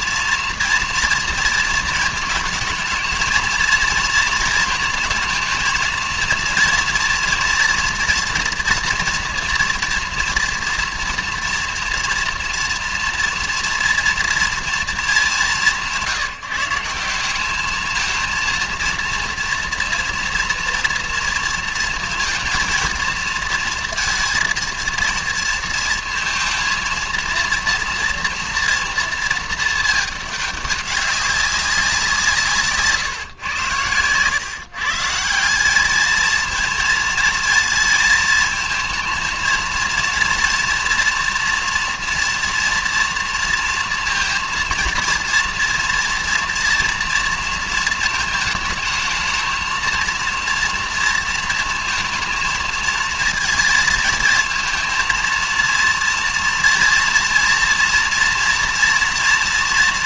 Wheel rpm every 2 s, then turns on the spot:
230, 220, 230, 230, 230, 230, 230, 230, 170, 230, 240, 230, 230, 230, 230, 200, 150, 140, 230, 220, 230, 240, 230, 230, 220, 230, 230, 220, 230, 230.
none